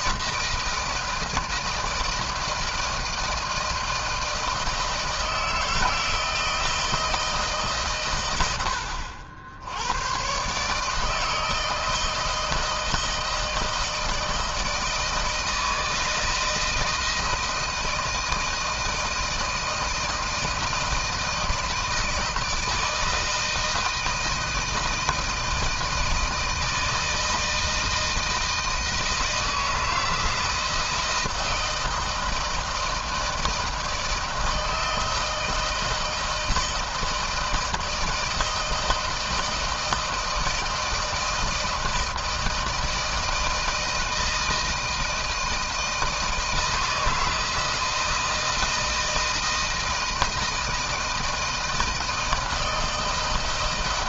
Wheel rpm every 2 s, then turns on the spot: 160, 160, 160, 160, 70, 160, 160, 160, 160, 160, 160, 160, 160, 160, 160, 160, 160, 160, 170, 160, 170, 160, 160, 160, 160, 160, 160.
none